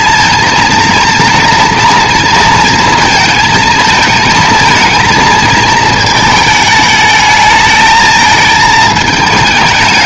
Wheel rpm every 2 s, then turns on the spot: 230, 230, 220, 220, 220.
none